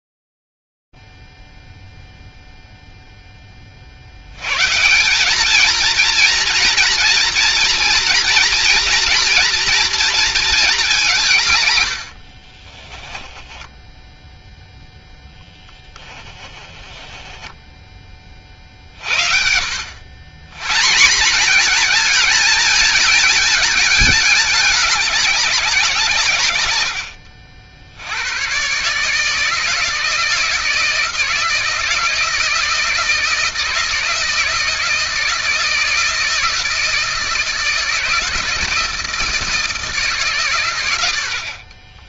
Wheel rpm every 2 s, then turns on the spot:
0, 0, 40, 220, 240, 230, 90, 10, 10, 30, 130, 220, 200, 120, 120, 160, 160, 160, 160, 160, 140.
12-14